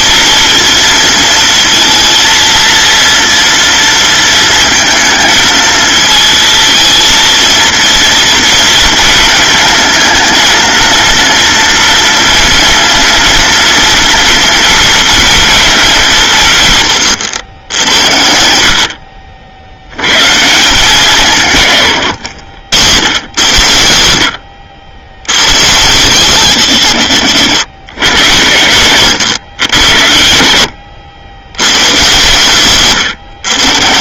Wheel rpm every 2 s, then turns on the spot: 230, 230, 230, 220, 230, 230, 240, 230, 130, 60, 170, 110, 80, 160, 130, 80, 140.
none